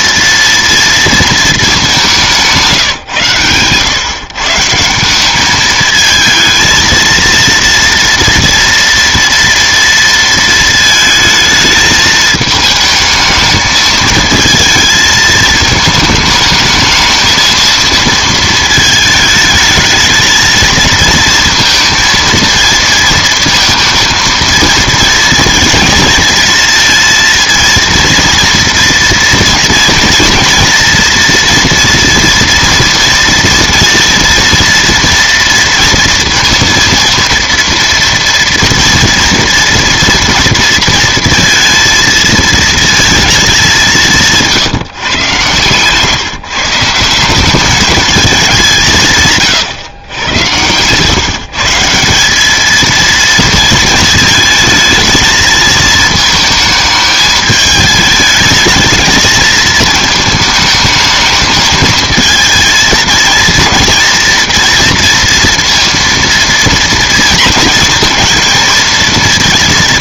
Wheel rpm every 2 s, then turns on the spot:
230, 160, 160, 230, 230, 220, 220, 220, 220, 220, 230, 230, 230, 230, 230, 240, 230, 230, 230, 230, 230, 220, 140, 150, 180, 130, 220, 220, 220, 220, 220, 220, 230, 230, 230.
none